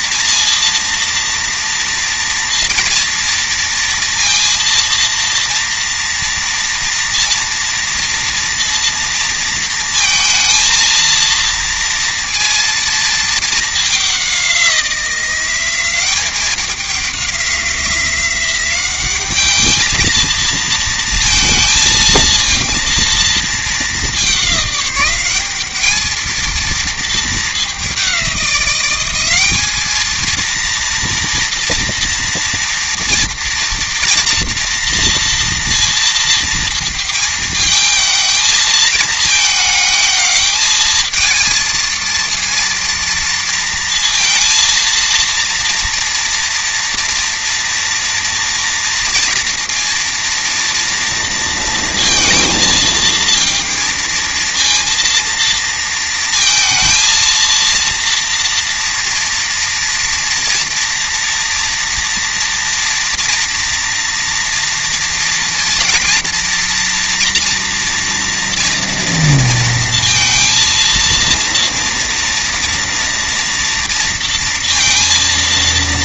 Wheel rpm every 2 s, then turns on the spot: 230, 230, 230, 230, 230, 230, 230, 190, 200, 190, 230, 230, 190, 230, 190, 230, 240, 230, 230, 220, 220, 230, 230, 230, 230, 230, 230, 230, 230, 230, 240, 240, 240, 240, 230, 230, 230, 230.
none